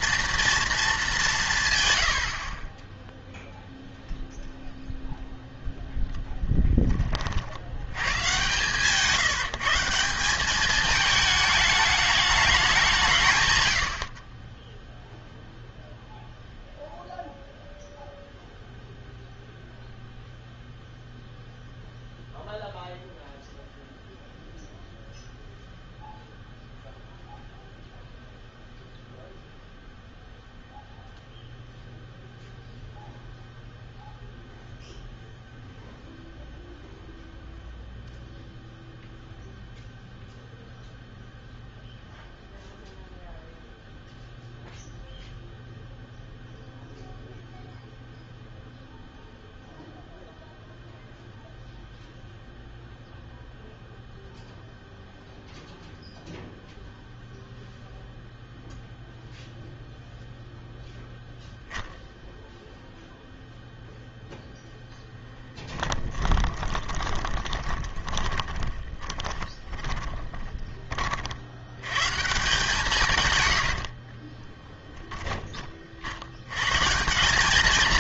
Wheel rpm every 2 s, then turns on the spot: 220, 30, 0, 10, 130, 200, 200, 10, 0, 0, 0, 0, 0, 0, 0, 0, 0, 0, 0, 0, 0, 0, 0, 0, 0, 0, 0, 0, 0, 0, 0, 0, 0, 20, 20, 20, 150, 10, 130.
66-72 74-76